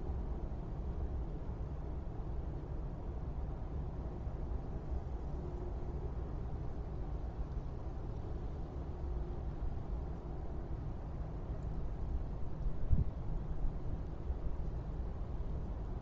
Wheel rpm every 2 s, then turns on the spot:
0, 0, 0, 0, 0, 0, 0, 0.
none